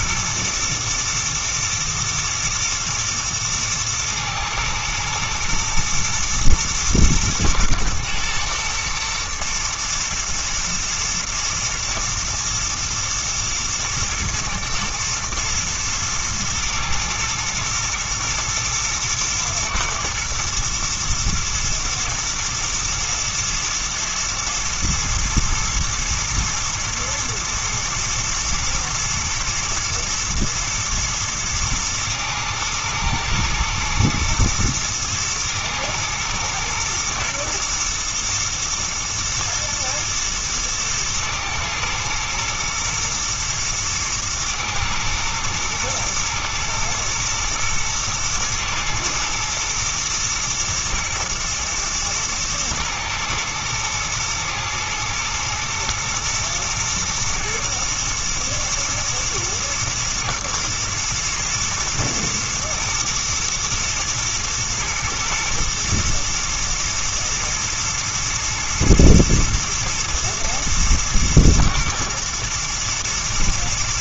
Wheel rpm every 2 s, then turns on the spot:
120, 120, 110, 120, 120, 120, 120, 110, 110, 110, 110, 110, 110, 110, 110, 110, 120, 110, 110, 110, 110, 110, 110, 110, 110, 120, 110, 110, 110, 110, 110, 120, 110, 110, 110, 110, 110.
none